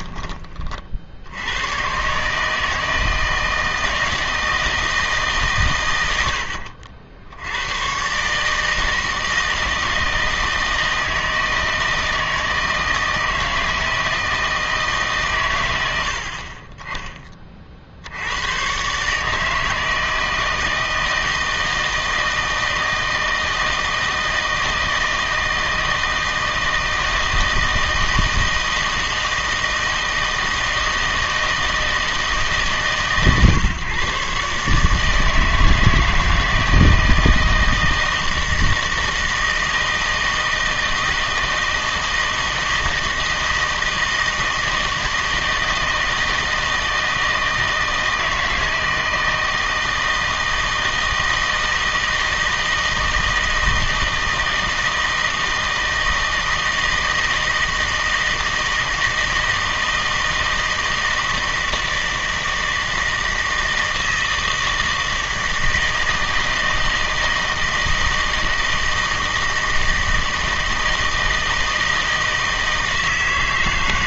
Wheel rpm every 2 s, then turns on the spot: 40, 160, 160, 70, 160, 160, 160, 160, 30, 120, 160, 160, 160, 160, 160, 160, 150, 150, 160, 160, 160, 160, 160, 160, 160, 160, 160, 160, 160, 160, 160, 160, 160, 160, 160, 160, 160.
none